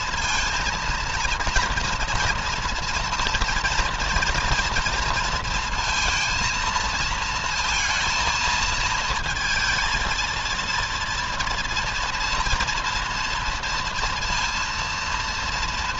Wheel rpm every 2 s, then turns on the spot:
230, 230, 230, 220, 220, 230, 230, 230.
none